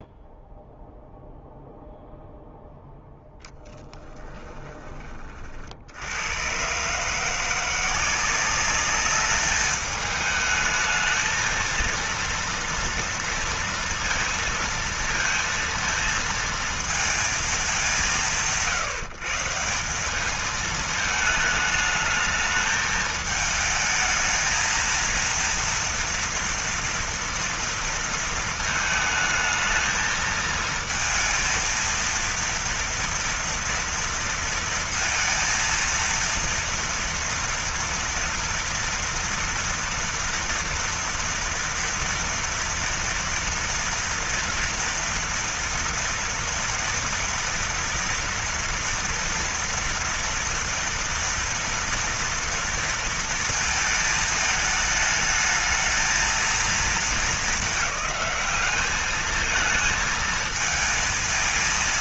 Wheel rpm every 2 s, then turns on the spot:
0, 0, 20, 130, 200, 220, 230, 230, 230, 150, 220, 220, 220, 230, 220, 220, 230, 230, 230, 230, 230, 230, 230, 230, 230, 230, 230, 220, 220, 210, 220.
none